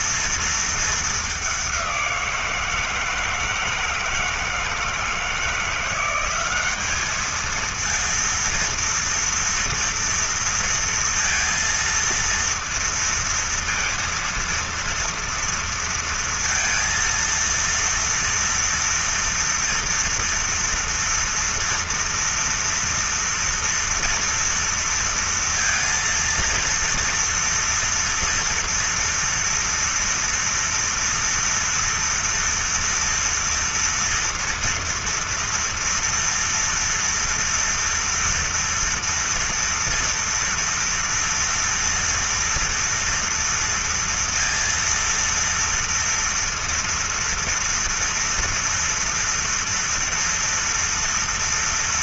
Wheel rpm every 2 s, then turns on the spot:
220, 170, 160, 200, 230, 230, 230, 230, 230, 240, 230, 230, 230, 230, 230, 240, 240, 230, 230, 230, 230, 230, 230, 230, 230, 230.
none